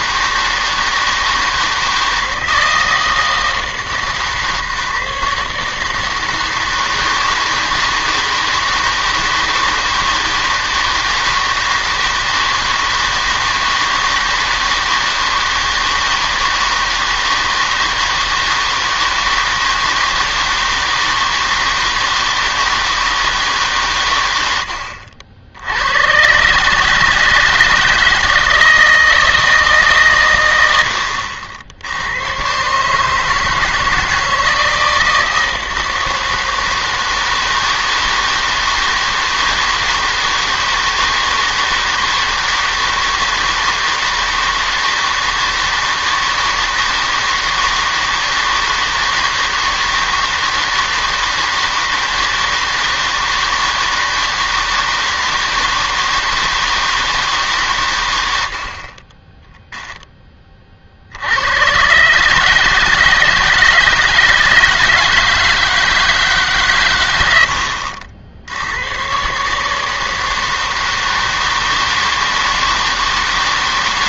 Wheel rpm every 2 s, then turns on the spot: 160, 160, 150, 160, 160, 160, 160, 160, 160, 160, 160, 160, 90, 150, 160, 70, 140, 160, 160, 160, 160, 160, 160, 160, 160, 160, 160, 160, 160, 50, 40, 160, 160, 140, 90, 160, 160.
none